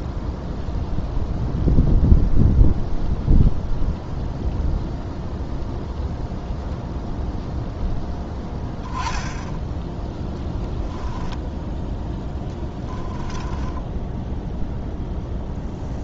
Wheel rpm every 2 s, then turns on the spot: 0, 0, 0, 0, 10, 0, 10, 0.
12-14